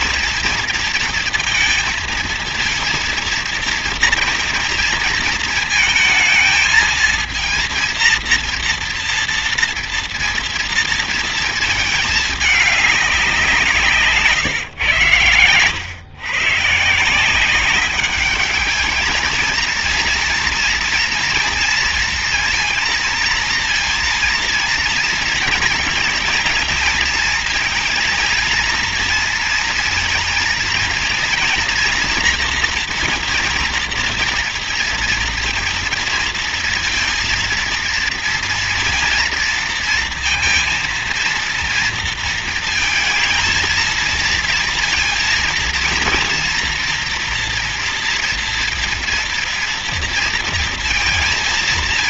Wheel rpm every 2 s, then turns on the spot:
230, 230, 230, 220, 230, 230, 200, 120, 150, 210, 230, 230, 230, 230, 230, 230, 240, 230, 230, 230, 230, 220, 230, 230, 230, 230.
none